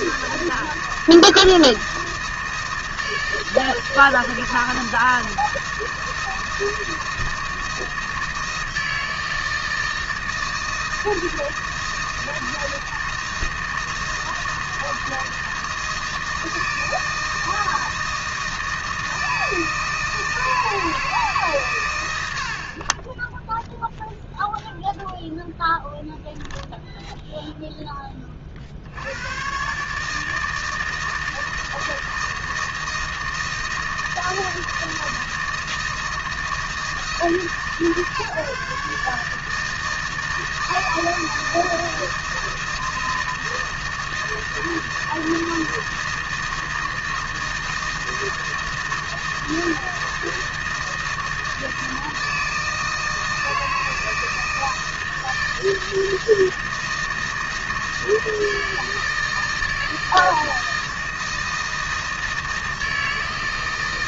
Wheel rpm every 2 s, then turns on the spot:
160, 160, 160, 160, 160, 160, 160, 160, 160, 160, 160, 70, 0, 0, 40, 160, 160, 160, 160, 150, 160, 160, 160, 160, 160, 160, 160, 160, 160, 160, 160, 160.
none